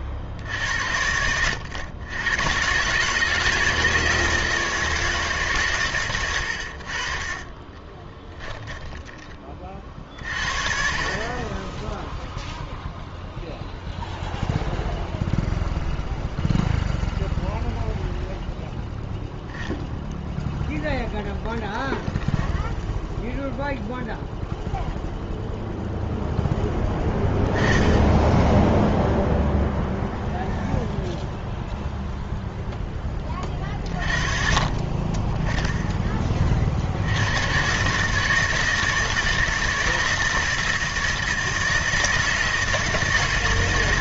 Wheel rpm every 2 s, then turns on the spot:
70, 120, 160, 80, 10, 40, 0, 0, 0, 0, 0, 0, 0, 10, 10, 0, 0, 40, 40, 160, 160, 160.
6-8